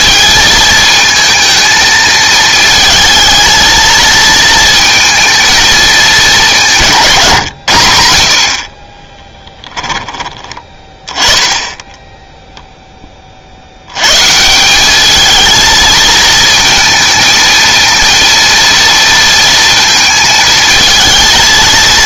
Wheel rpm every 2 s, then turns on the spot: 220, 220, 230, 190, 40, 20, 0, 180, 230, 230, 220.
8-10